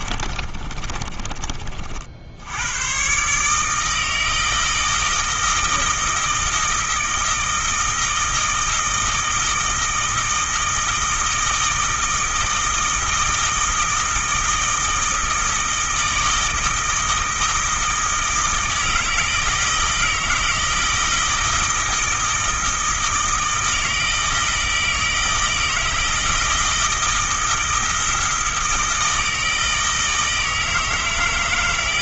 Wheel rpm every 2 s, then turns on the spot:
30, 110, 160, 160, 160, 160, 160, 160, 160, 160, 160, 160, 160, 160, 160, 160.
0-2